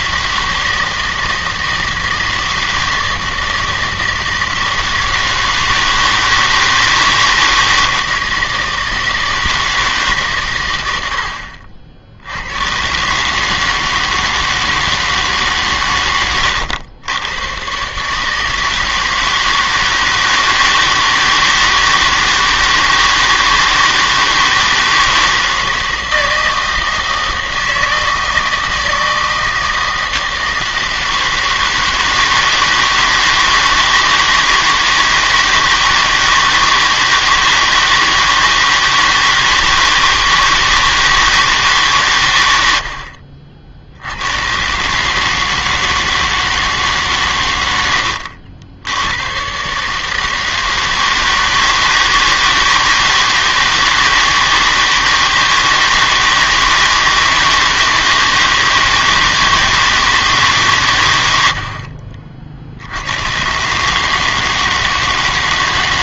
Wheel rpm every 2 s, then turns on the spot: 160, 160, 160, 160, 160, 110, 100, 160, 100, 160, 160, 160, 160, 160, 160, 160, 160, 160, 160, 160, 160, 90, 120, 150, 80, 160, 160, 160, 160, 160, 140, 70, 160.
16-18